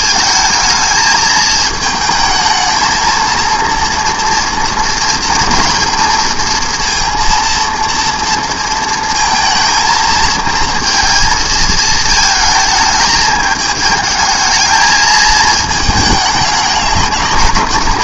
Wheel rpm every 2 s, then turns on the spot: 220, 220, 230, 230, 230, 220, 220, 220, 210.
none